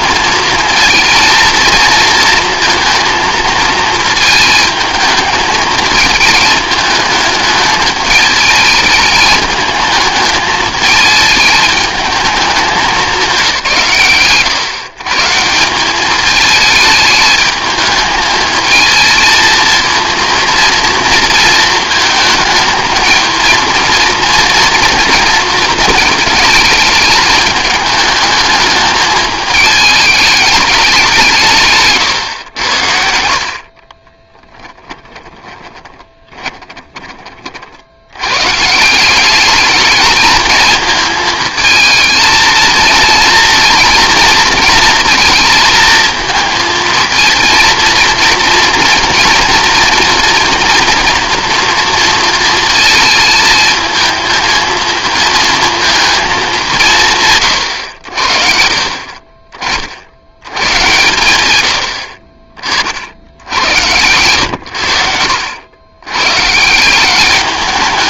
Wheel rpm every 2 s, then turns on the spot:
230, 220, 220, 220, 220, 210, 200, 140, 210, 220, 230, 220, 230, 220, 210, 210, 90, 20, 20, 170, 220, 220, 230, 230, 230, 230, 230, 230, 170, 50, 110, 70, 80, 190.
34-36